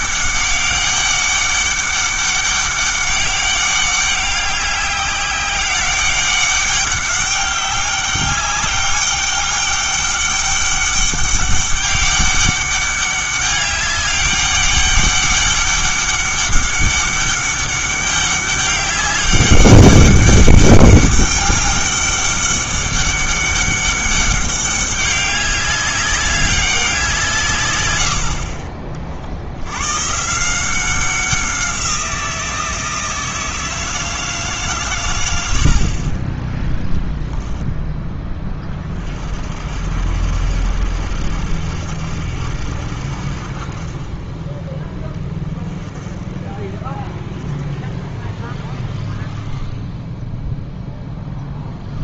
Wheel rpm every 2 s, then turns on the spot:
200, 200, 200, 200, 200, 200, 200, 200, 200, 200, 200, 200, 200, 200, 50, 180, 170, 140, 10, 30, 70, 60, 20, 30, 20, 0.
none